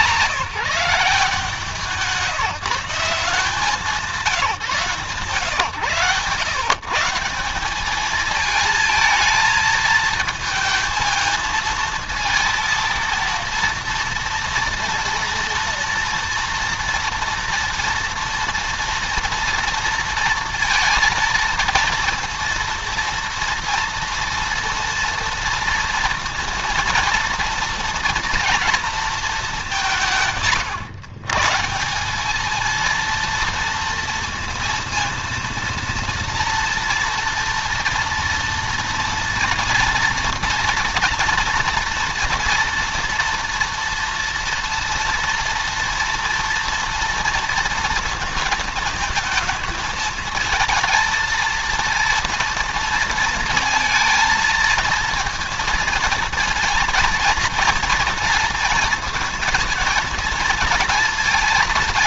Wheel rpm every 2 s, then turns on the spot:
150, 150, 170, 140, 220, 220, 230, 230, 240, 230, 230, 230, 230, 230, 230, 130, 220, 230, 230, 230, 230, 230, 230, 240, 220, 220, 230, 230, 230, 230, 220.
none